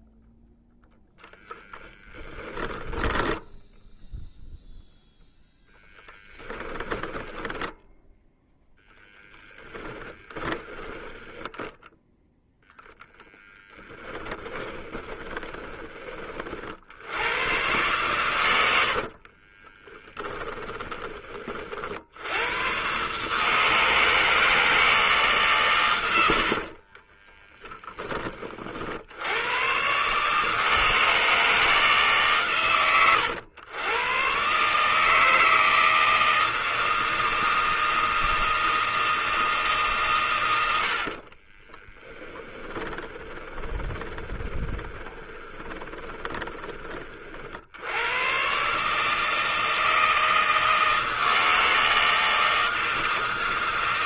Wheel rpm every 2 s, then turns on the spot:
0, 20, 0, 10, 10, 20, 0, 10, 60, 100, 20, 120, 160, 50, 40, 150, 130, 130, 160, 160, 90, 10, 20, 30, 140, 160, 160.
2-4 6-8 14-16 18-22 26-28 42-46